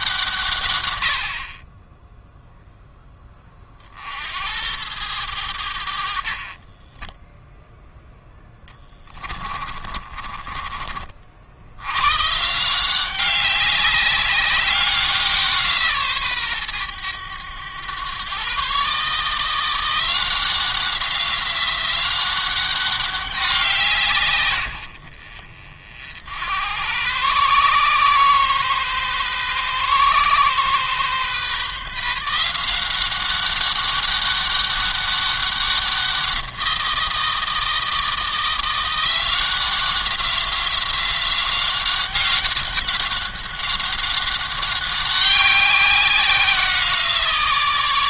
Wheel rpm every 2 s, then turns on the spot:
110, 10, 90, 20, 20, 40, 170, 190, 110, 140, 190, 190, 90, 100, 130, 130, 180, 200, 170, 180, 190, 190, 190, 170.
6-10